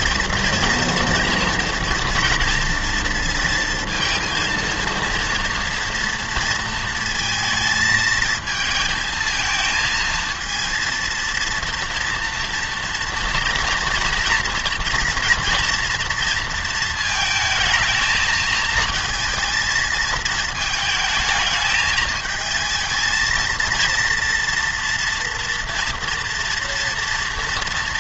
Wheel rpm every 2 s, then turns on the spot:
230, 230, 230, 230, 220, 220, 230, 230, 230, 220, 220, 220, 230, 230.
none